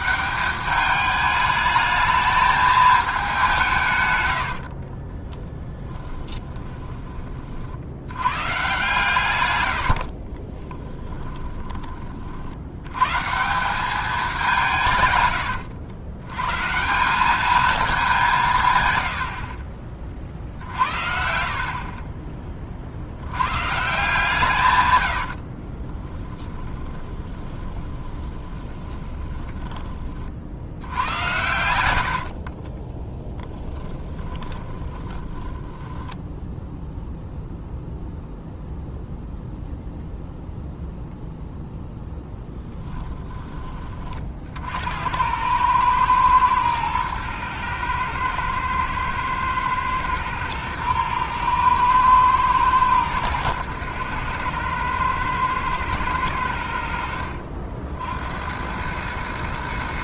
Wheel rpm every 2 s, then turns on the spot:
210, 220, 50, 20, 140, 30, 90, 170, 160, 130, 50, 40, 120, 20, 20, 80, 20, 20, 0, 0, 0, 10, 70, 110, 110, 110, 110, 100, 80, 90.
4-6 10-12 26-30 32-36